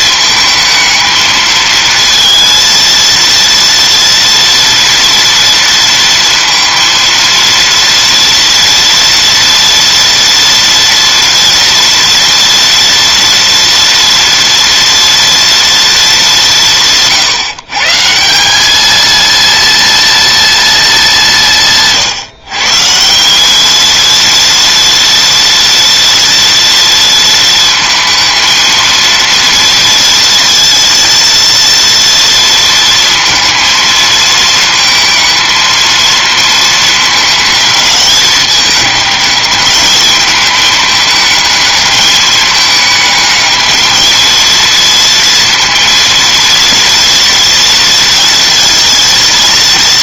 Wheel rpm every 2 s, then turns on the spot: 220, 230, 230, 230, 230, 230, 230, 230, 170, 220, 220, 170, 230, 230, 230, 230, 230, 220, 220, 210, 210, 210, 230, 230, 230.
none